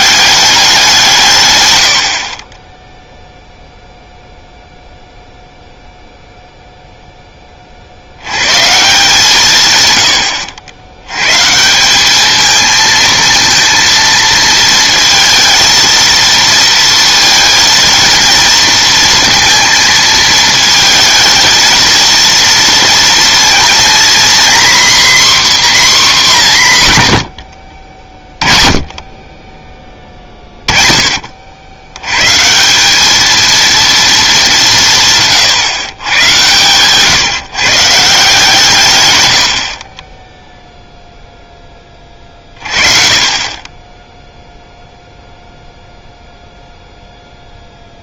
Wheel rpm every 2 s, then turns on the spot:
190, 10, 0, 0, 150, 80, 220, 230, 230, 230, 220, 230, 260, 160, 30, 20, 170, 190, 130, 140, 0, 30, 0, 0.
none